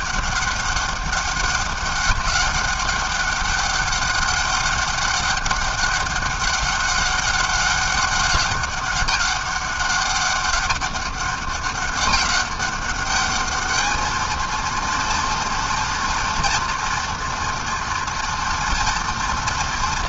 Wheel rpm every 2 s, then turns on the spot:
200, 200, 200, 200, 200, 200, 210, 230, 230, 230.
none